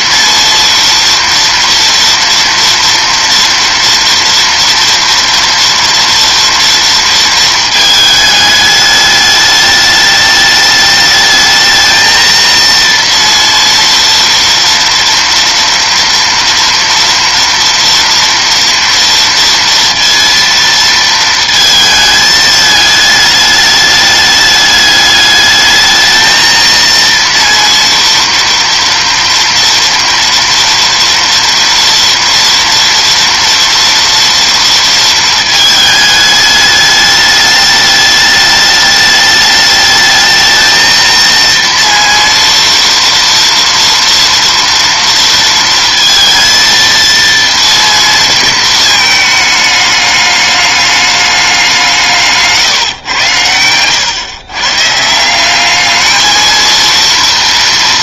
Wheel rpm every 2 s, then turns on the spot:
230, 230, 230, 230, 210, 210, 230, 230, 230, 230, 230, 210, 210, 230, 230, 230, 230, 230, 210, 210, 220, 230, 230, 230, 220, 210, 140, 140, 230.
none